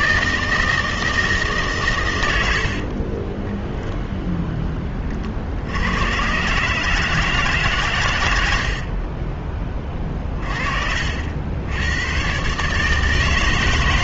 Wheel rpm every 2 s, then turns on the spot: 160, 60, 10, 140, 70, 50, 140.
2-4